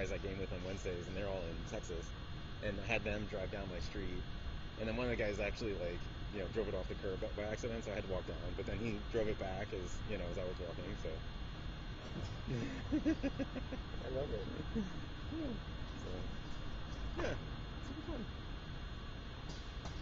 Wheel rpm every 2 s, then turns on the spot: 0, 0, 0, 0, 0, 0, 0, 0, 0, 0.
none